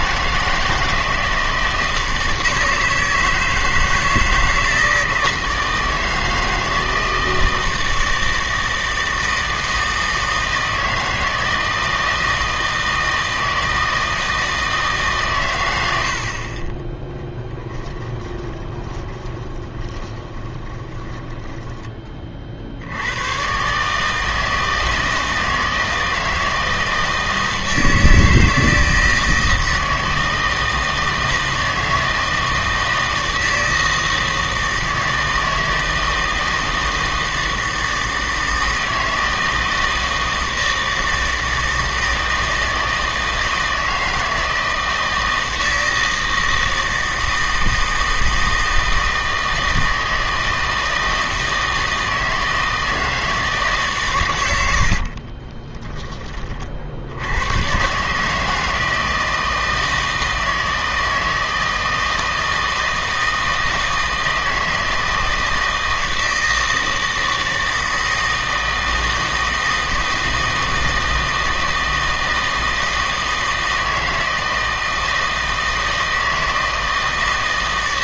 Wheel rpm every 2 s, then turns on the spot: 160, 160, 160, 160, 160, 160, 160, 160, 20, 20, 20, 60, 160, 160, 160, 160, 160, 160, 160, 160, 160, 160, 160, 160, 160, 160, 160, 90, 30, 160, 160, 160, 160, 160, 160, 160, 160, 160, 160.
16-22 54-56